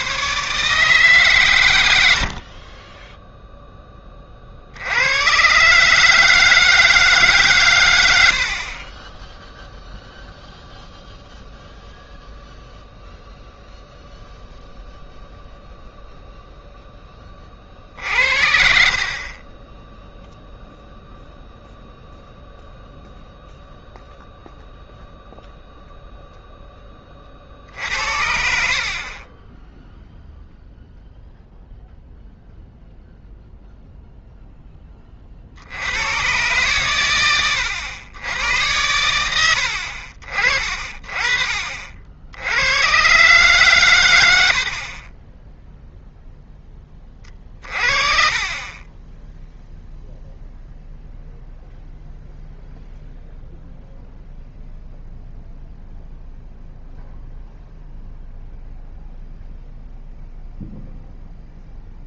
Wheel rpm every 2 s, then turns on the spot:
150, 30, 60, 160, 30, 0, 0, 0, 0, 60, 0, 0, 0, 10, 60, 0, 0, 10, 120, 90, 40, 70, 80, 10, 30, 0, 0, 0, 0, 0, 0.
none